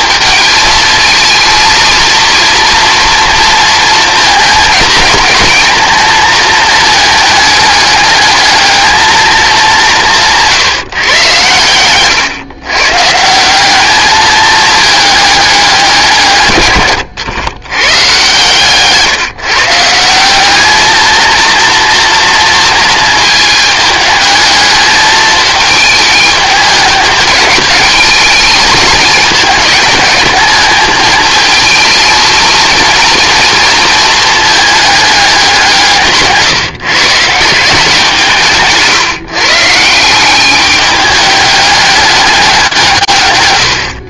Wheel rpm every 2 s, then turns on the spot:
220, 240, 220, 220, 220, 140, 130, 210, 130, 140, 210, 230, 220, 200, 220, 220, 220, 210, 150, 160, 210, 150.
none